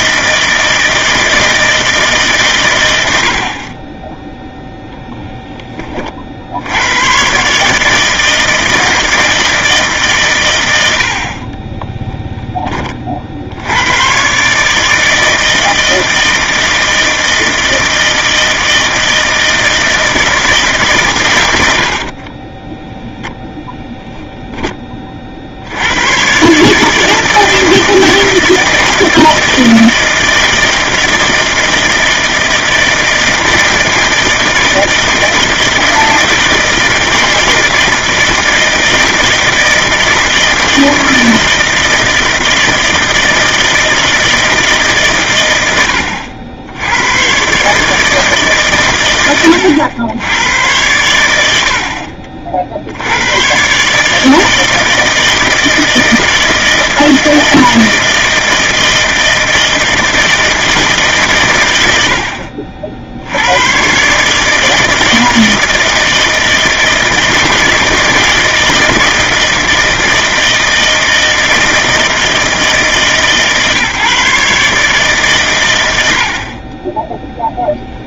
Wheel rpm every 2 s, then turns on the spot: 160, 120, 0, 70, 160, 110, 20, 140, 160, 160, 150, 20, 10, 140, 160, 160, 160, 160, 160, 160, 160, 160, 160, 80, 140, 100, 60, 160, 160, 160, 160, 50, 150, 160, 160, 160, 160, 140, 30.
22-24